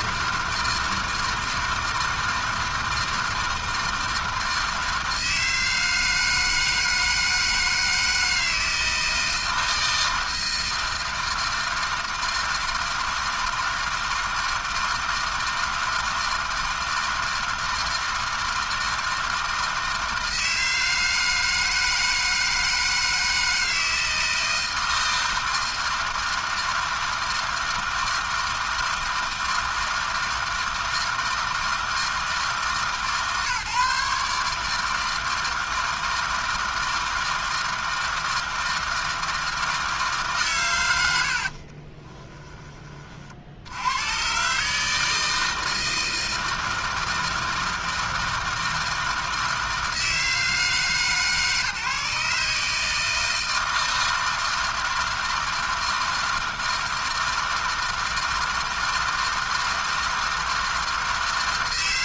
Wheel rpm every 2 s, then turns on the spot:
160, 160, 160, 160, 160, 160, 160, 160, 160, 160, 160, 160, 160, 160, 160, 160, 140, 150, 160, 160, 130, 20, 150, 160, 160, 160, 150, 160, 160, 160, 160.
none